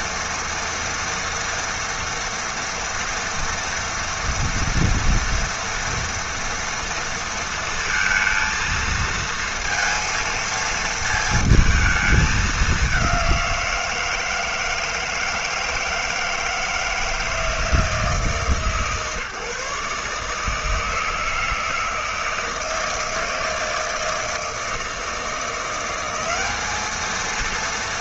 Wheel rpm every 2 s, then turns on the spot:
230, 230, 230, 230, 230, 230, 200, 160, 160, 150, 160, 160, 160, 200.
none